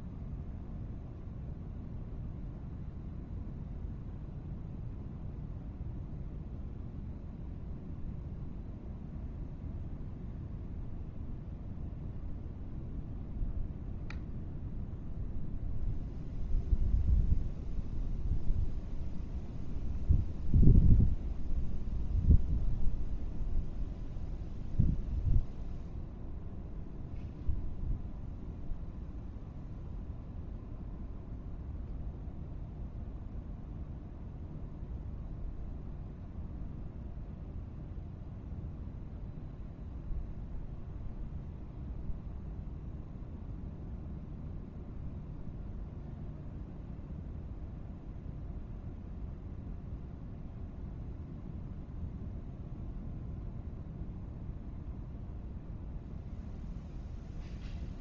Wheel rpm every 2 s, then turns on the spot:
0, 0, 0, 0, 0, 0, 0, 0, 0, 0, 0, 0, 0, 0, 0, 0, 0, 0, 0, 0, 0, 0, 0, 0, 0, 0, 0, 0, 0.
none